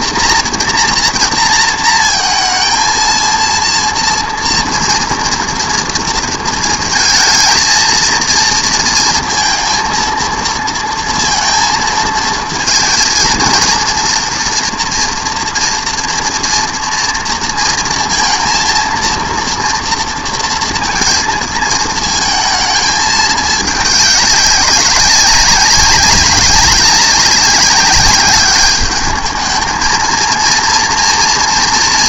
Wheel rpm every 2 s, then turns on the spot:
240, 220, 230, 230, 230, 230, 220, 240, 230, 230, 230, 220, 200, 200, 210, 230.
none